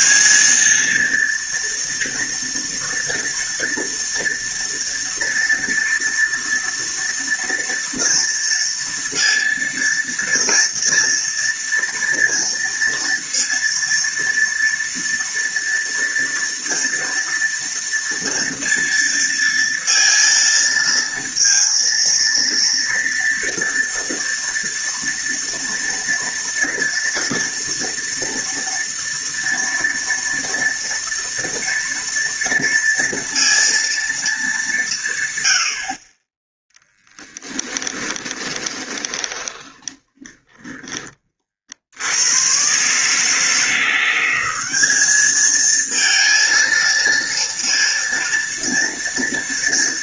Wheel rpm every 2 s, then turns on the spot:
230, 230, 230, 230, 230, 230, 230, 230, 230, 230, 230, 230, 230, 230, 230, 230, 230, 190, 10, 20, 20, 130, 200, 230, 230.
36-40